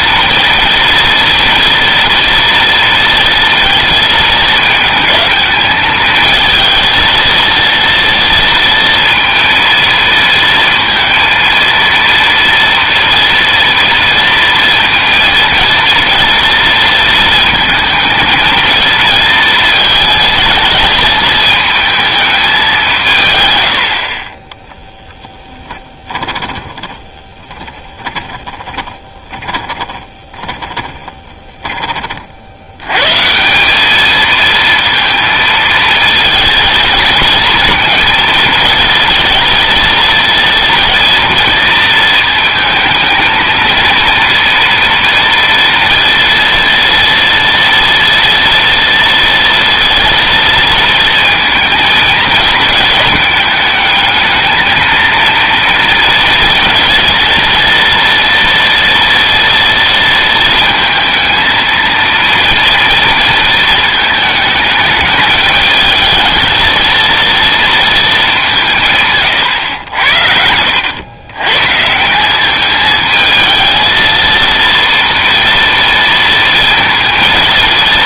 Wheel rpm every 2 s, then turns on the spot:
230, 230, 220, 220, 230, 230, 230, 230, 230, 220, 220, 220, 30, 10, 20, 20, 90, 230, 220, 230, 230, 220, 240, 230, 230, 230, 220, 220, 230, 230, 230, 230, 220, 230, 170, 100, 210, 230, 230.
26-32